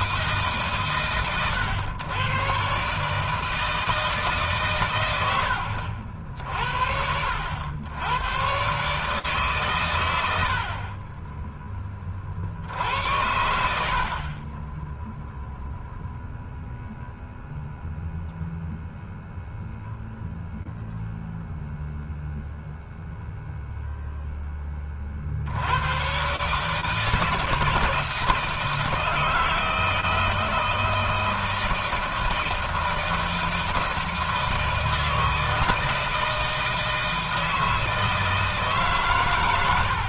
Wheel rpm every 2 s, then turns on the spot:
130, 130, 130, 60, 130, 40, 80, 10, 0, 0, 0, 0, 20, 140, 160, 160, 160, 160, 160, 150.
none